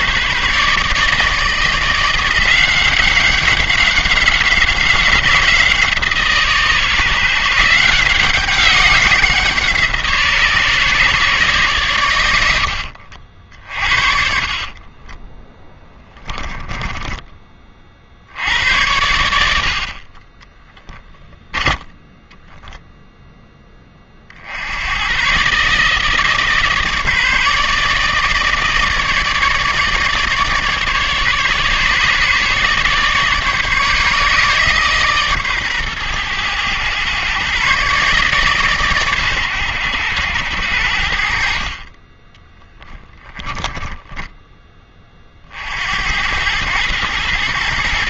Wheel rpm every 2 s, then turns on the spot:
150, 180, 190, 150, 180, 140, 80, 40, 10, 90, 10, 0, 80, 160, 160, 150, 150, 140, 110, 140, 80, 10, 20, 110.
14-18 20-22 42-44